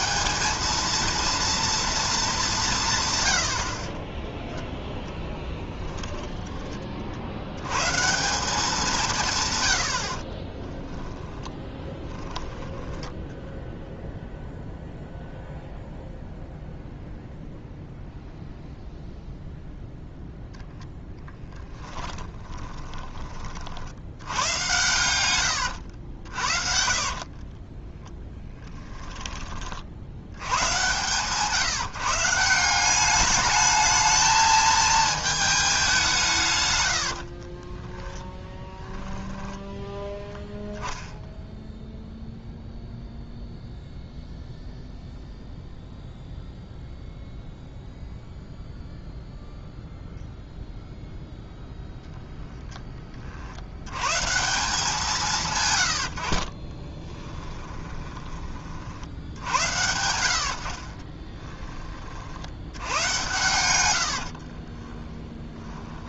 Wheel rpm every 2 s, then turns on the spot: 210, 200, 0, 10, 180, 20, 10, 0, 0, 0, 0, 10, 100, 60, 20, 90, 170, 220, 130, 10, 0, 0, 0, 0, 0, 0, 0, 150, 30, 40, 70, 80, 40.
10-12 22-24 26-30 38-40 56-58 60-62 64-66